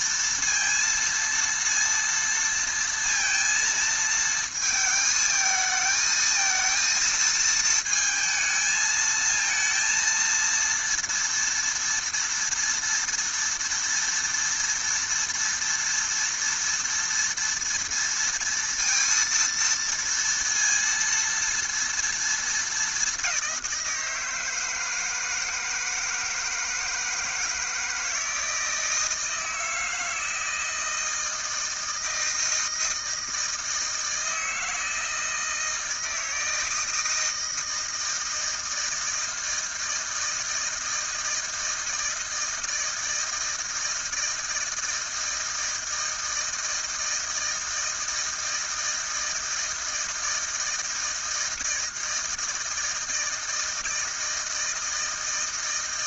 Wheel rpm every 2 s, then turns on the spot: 230, 230, 220, 230, 220, 230, 230, 240, 230, 230, 230, 190, 160, 160, 160, 160, 160, 160, 160, 160, 160, 160, 160, 160, 160, 160, 160, 160.
none